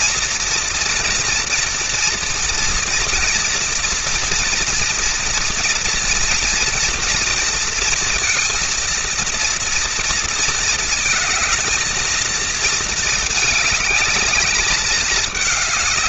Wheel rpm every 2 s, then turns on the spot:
230, 240, 230, 230, 230, 220, 220, 210.
none